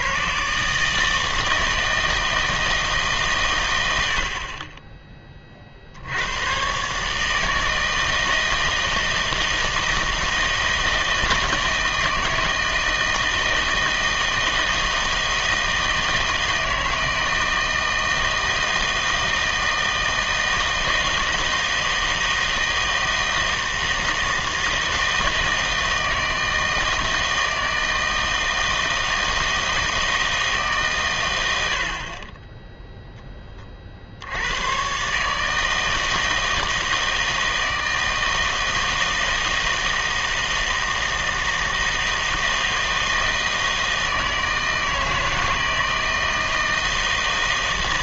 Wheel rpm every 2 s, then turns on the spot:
150, 160, 30, 120, 160, 160, 160, 160, 160, 160, 160, 160, 160, 160, 160, 150, 10, 110, 160, 160, 160, 160, 160, 160.
32-34